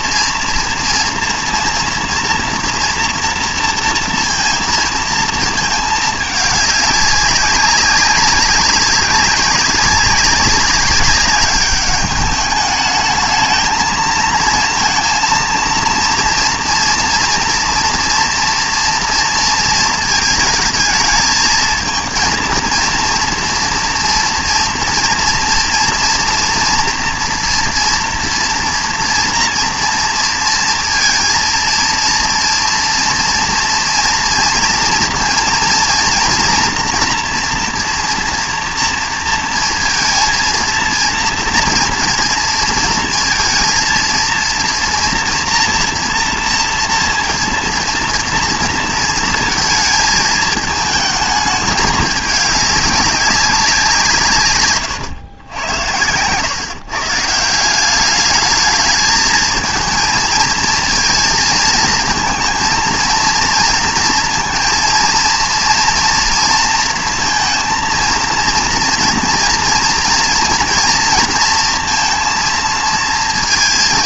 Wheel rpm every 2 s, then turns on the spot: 230, 230, 230, 200, 190, 200, 210, 230, 230, 230, 220, 230, 230, 230, 230, 230, 230, 230, 240, 230, 230, 230, 230, 230, 230, 220, 210, 130, 140, 210, 230, 230, 230, 230, 230, 230, 230.
54-56